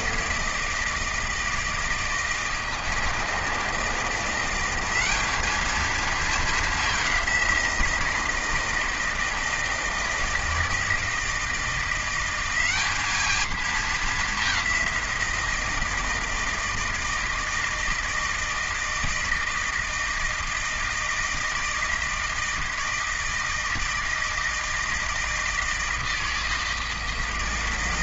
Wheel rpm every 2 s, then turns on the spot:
160, 160, 180, 210, 160, 160, 190, 190, 160, 160, 160, 160, 160, 160.
none